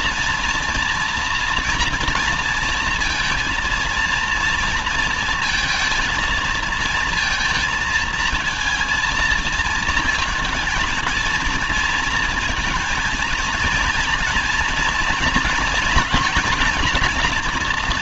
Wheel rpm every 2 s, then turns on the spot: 230, 230, 230, 220, 230, 230, 230, 230, 240.
none